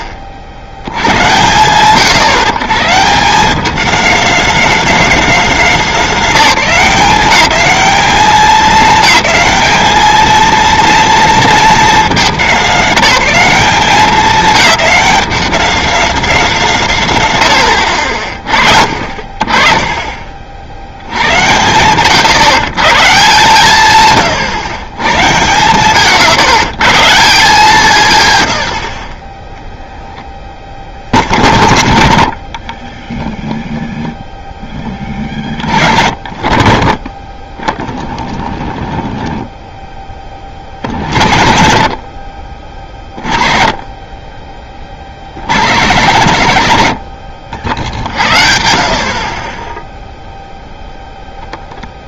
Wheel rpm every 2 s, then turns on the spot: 60, 140, 210, 190, 200, 230, 200, 200, 180, 40, 60, 140, 120, 120, 100, 10, 50, 10, 30, 0, 40, 50, 30, 120, 60, 0.
none